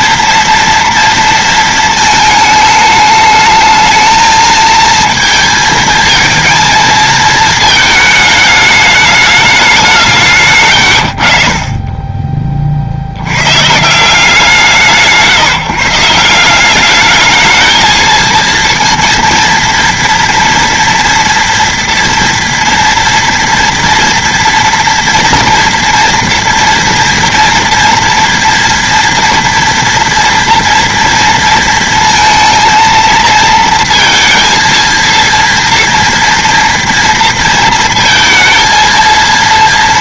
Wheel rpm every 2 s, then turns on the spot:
230, 210, 230, 230, 210, 110, 20, 150, 200, 230, 240, 230, 230, 230, 230, 230, 230, 230, 230, 220.
none